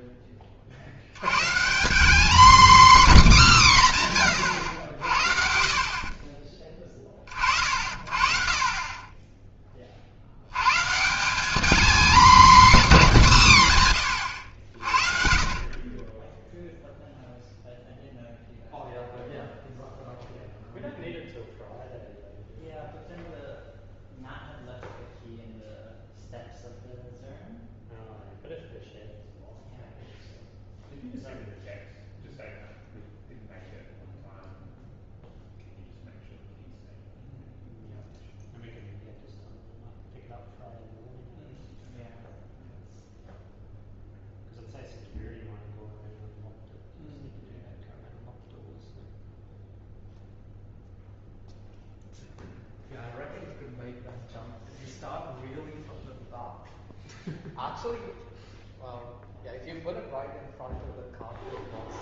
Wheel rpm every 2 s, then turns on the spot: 70, 270, 100, 20, 40, 120, 250, 60, 0, 0, 0, 0, 0, 0, 0, 0, 0, 0, 0, 0, 0, 0, 0, 0, 0, 0, 0, 0, 0, 0, 0.
none